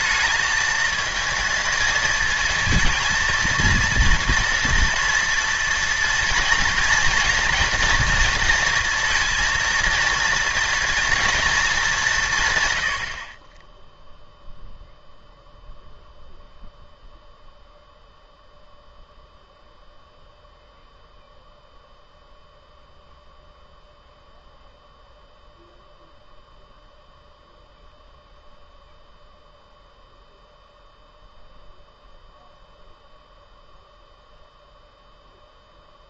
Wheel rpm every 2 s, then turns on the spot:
220, 230, 230, 230, 230, 230, 120, 0, 0, 0, 0, 0, 0, 0, 0, 0, 0, 0.
none